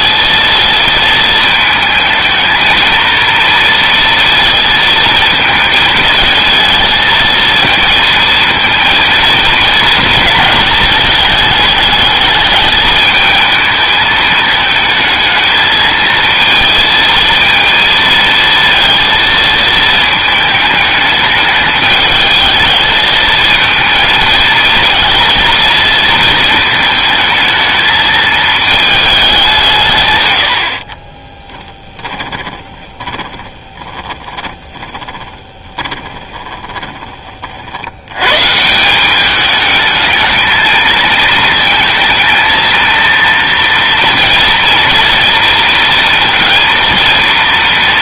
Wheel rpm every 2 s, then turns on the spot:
230, 230, 230, 220, 230, 220, 210, 220, 230, 230, 210, 220, 230, 220, 210, 30, 20, 30, 20, 160, 220, 230, 230, 230.
30-38